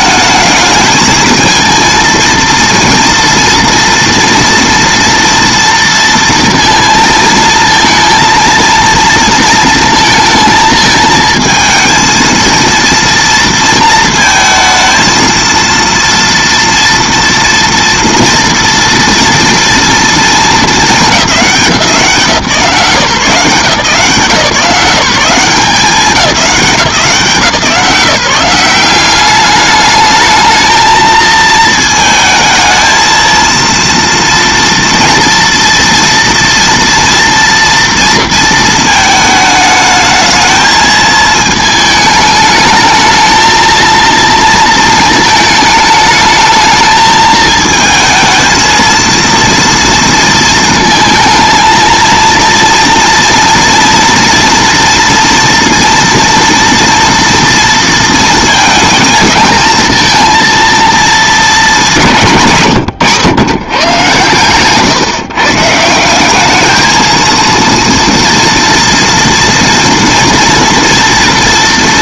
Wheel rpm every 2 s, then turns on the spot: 220, 230, 230, 230, 230, 220, 230, 220, 230, 230, 220, 160, 170, 190, 190, 220, 220, 230, 230, 220, 220, 220, 230, 220, 230, 230, 240, 230, 230, 230, 230, 130, 130, 210, 230, 230.
62-66